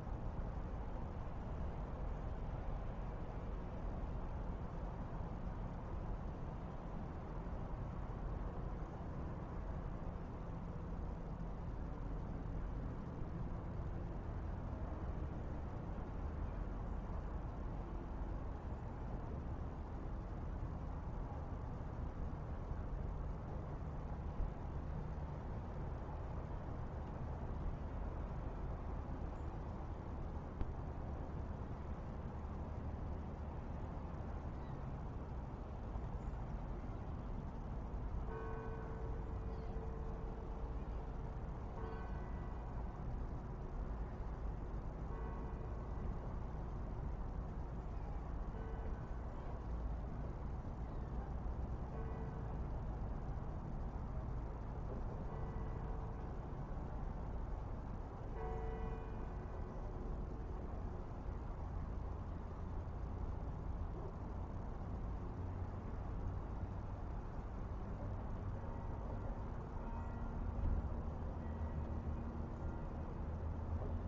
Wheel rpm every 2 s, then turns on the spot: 0, 0, 0, 0, 0, 0, 0, 0, 0, 0, 0, 0, 0, 0, 0, 0, 0, 0, 0, 0, 0, 0, 0, 0, 0, 0, 0, 0, 0, 0, 0, 0, 0, 0, 0, 0, 0.
none